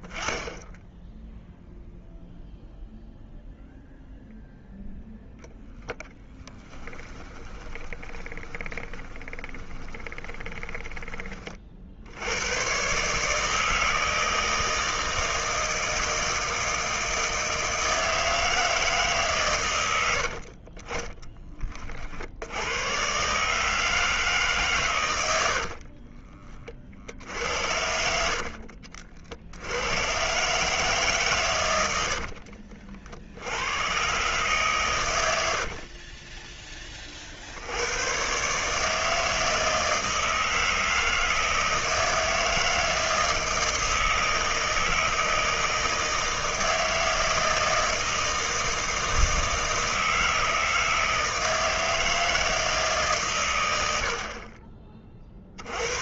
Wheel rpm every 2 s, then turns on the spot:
10, 0, 0, 10, 20, 20, 110, 160, 160, 160, 40, 80, 140, 40, 60, 140, 50, 130, 20, 140, 160, 160, 160, 160, 160, 160, 160, 40.
6-12 20-22 28-30 32-34